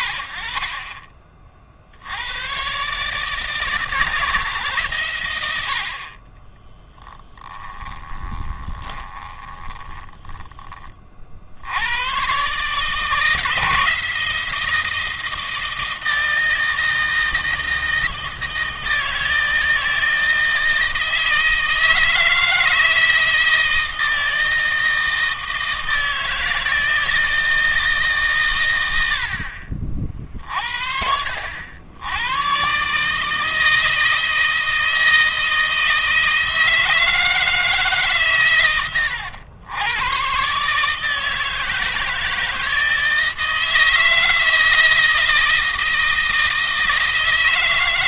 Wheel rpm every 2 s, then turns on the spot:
30, 140, 130, 30, 20, 40, 150, 160, 160, 160, 160, 160, 160, 160, 90, 60, 140, 160, 160, 100, 150, 160, 160, 160.
6-10